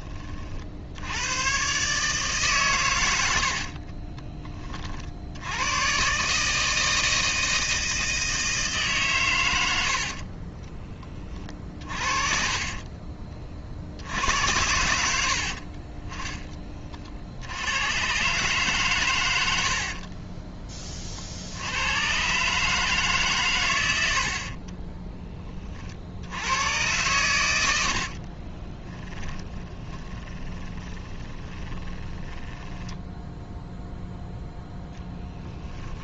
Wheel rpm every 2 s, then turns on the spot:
60, 130, 40, 160, 150, 20, 30, 80, 30, 130, 40, 150, 20, 90, 20, 20, 10, 10.
24-26 28-34